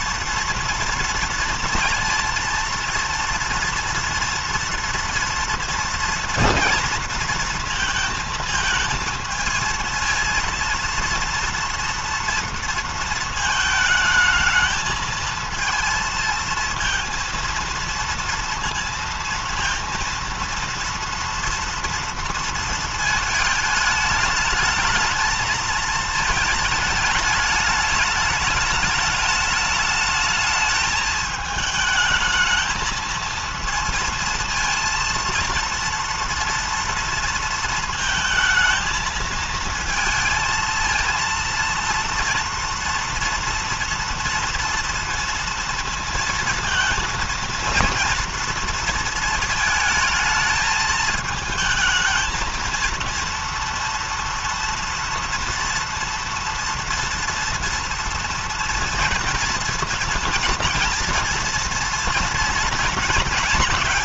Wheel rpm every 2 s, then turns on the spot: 230, 230, 230, 230, 230, 230, 230, 220, 230, 230, 230, 230, 220, 220, 210, 210, 220, 230, 230, 220, 220, 230, 230, 230, 230, 220, 230, 230, 230, 230, 230, 230.
none